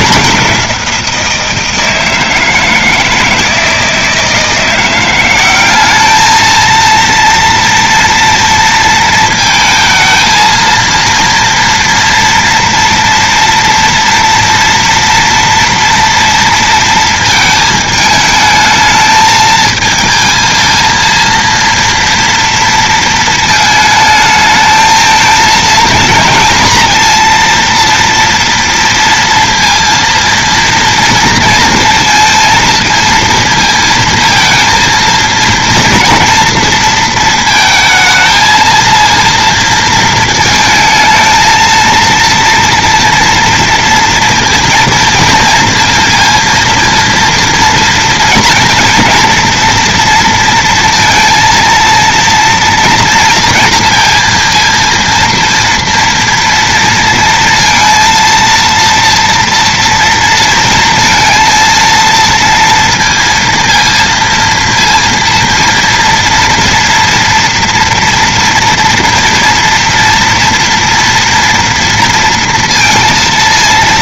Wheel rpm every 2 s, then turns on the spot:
170, 160, 170, 220, 230, 230, 230, 230, 230, 220, 220, 230, 220, 230, 230, 230, 230, 230, 230, 220, 220, 230, 230, 230, 230, 230, 230, 230, 230, 230, 230, 230, 230, 230, 230, 230, 230.
none